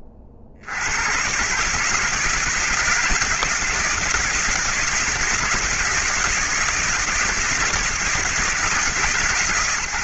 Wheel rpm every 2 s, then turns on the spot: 50, 170, 160, 160, 160.
none